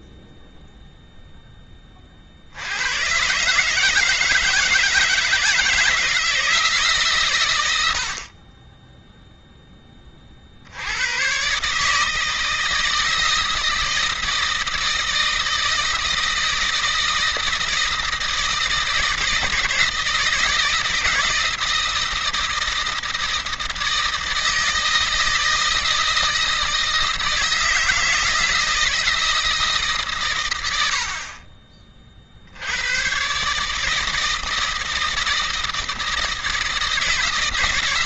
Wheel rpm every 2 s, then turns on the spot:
0, 80, 160, 160, 30, 70, 160, 160, 160, 160, 160, 160, 160, 160, 160, 100, 80, 160, 160.
none